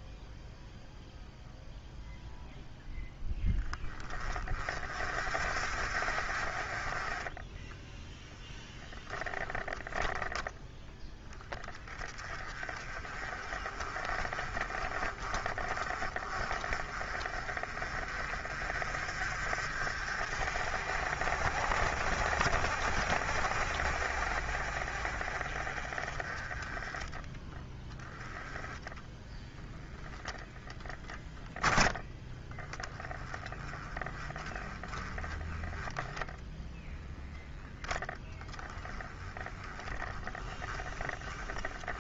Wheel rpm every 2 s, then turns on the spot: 0, 0, 40, 40, 10, 10, 30, 30, 40, 40, 50, 50, 50, 20, 10, 10, 10, 20, 0, 10, 10.
none